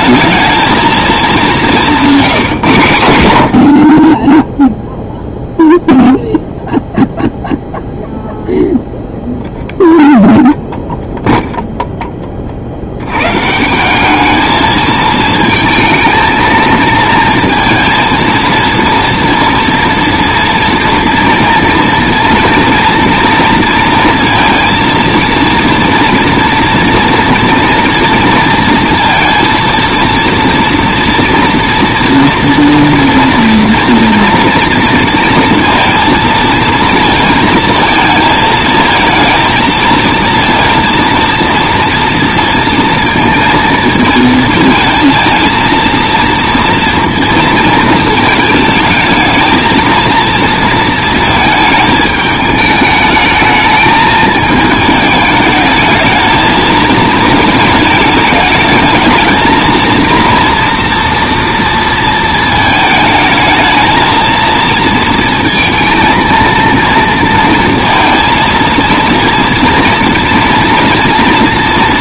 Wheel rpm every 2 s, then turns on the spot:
220, 160, 10, 0, 0, 0, 40, 210, 230, 230, 230, 230, 230, 230, 230, 230, 230, 230, 230, 220, 230, 230, 230, 230, 220, 230, 220, 220, 220, 220, 230, 220, 230, 230, 230, 230.
none